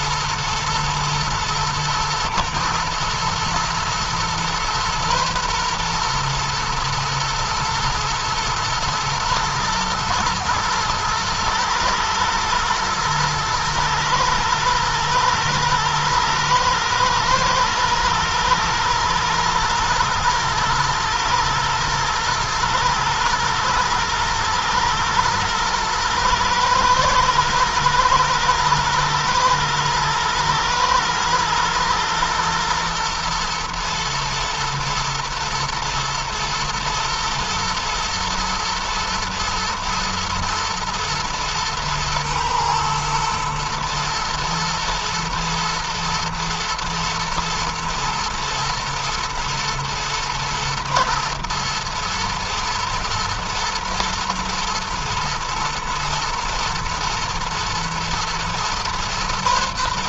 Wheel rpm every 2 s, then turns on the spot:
120, 120, 120, 120, 110, 110, 110, 110, 110, 110, 110, 110, 110, 120, 110, 120, 110, 110, 120, 120, 120, 110, 110, 110, 110, 110, 110, 120, 120, 120.
none